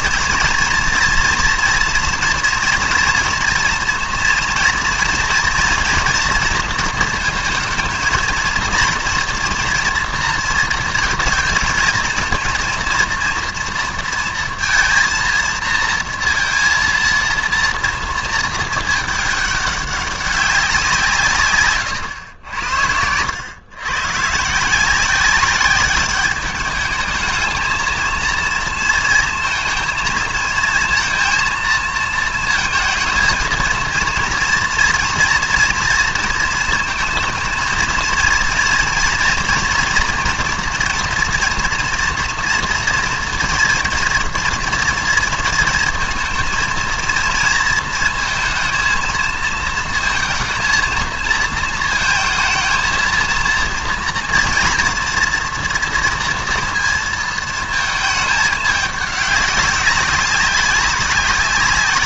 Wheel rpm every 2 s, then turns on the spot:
230, 230, 230, 230, 230, 230, 230, 230, 230, 220, 190, 90, 170, 210, 230, 230, 230, 230, 230, 230, 240, 230, 230, 230, 230, 230, 220, 230, 230, 210, 200.
none